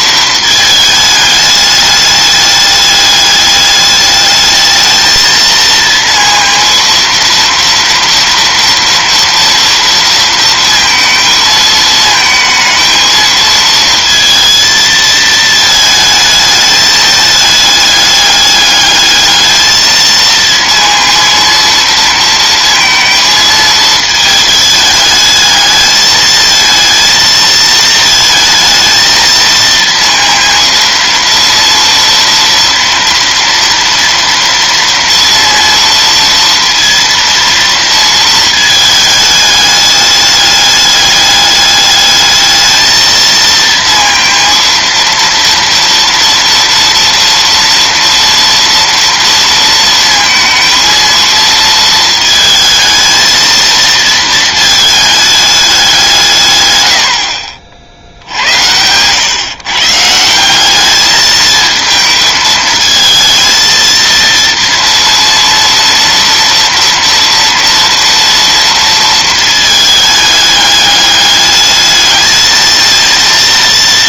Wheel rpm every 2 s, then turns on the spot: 220, 210, 220, 230, 230, 230, 220, 230, 220, 210, 230, 230, 220, 220, 220, 230, 230, 230, 230, 220, 210, 220, 230, 230, 230, 230, 220, 220, 120, 90, 200, 220, 230, 230, 230, 210, 220.
none